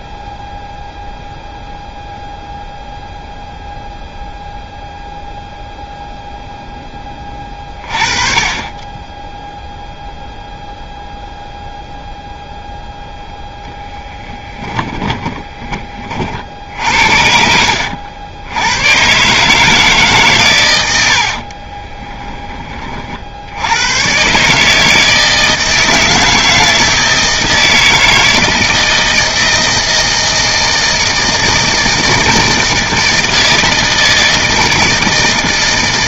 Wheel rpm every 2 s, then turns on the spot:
0, 0, 0, 10, 20, 0, 0, 10, 60, 90, 100, 30, 150, 160, 160, 160, 160, 160.
14-16